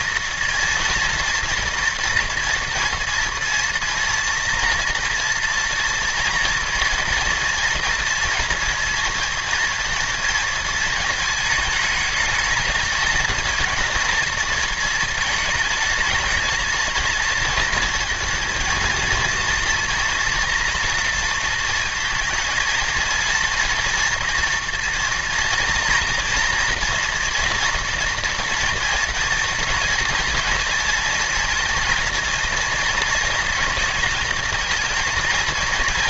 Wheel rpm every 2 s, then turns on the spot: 230, 240, 230, 230, 230, 220, 220, 230, 230, 230, 230, 230, 230, 240, 240, 240, 230, 230.
none